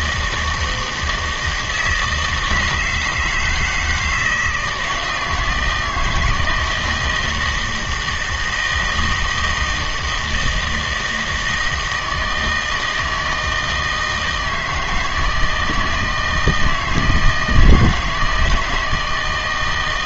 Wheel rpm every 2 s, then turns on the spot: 160, 160, 160, 170, 160, 160, 160, 160, 160, 160.
none